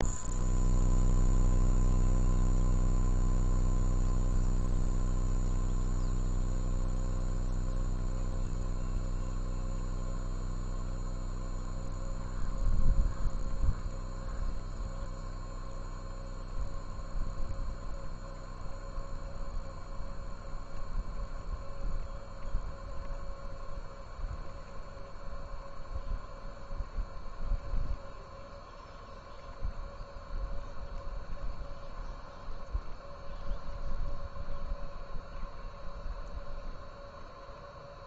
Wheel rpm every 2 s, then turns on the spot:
0, 0, 0, 0, 0, 0, 0, 0, 0, 0, 0, 0, 0, 0, 0, 0, 0, 0, 0.
none